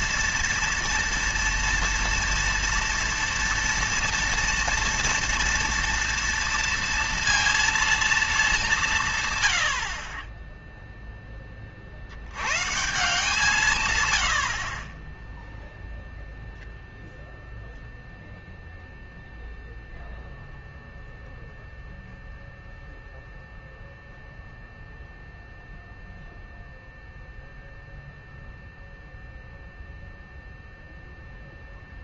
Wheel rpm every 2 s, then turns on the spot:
230, 230, 230, 230, 180, 0, 130, 30, 0, 0, 0, 0, 0, 0, 0, 0.
none